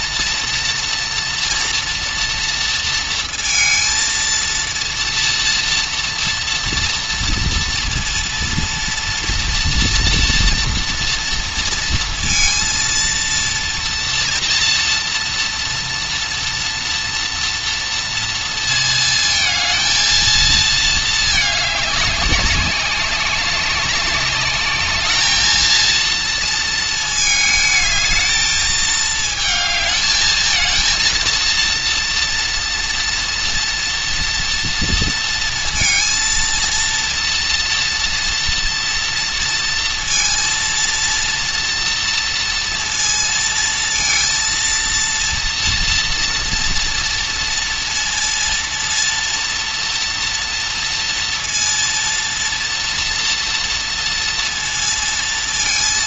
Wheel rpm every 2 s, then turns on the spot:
230, 230, 230, 230, 230, 230, 230, 230, 230, 230, 220, 200, 210, 230, 220, 220, 230, 230, 230, 230, 230, 230, 230, 230, 230, 230, 230, 230.
none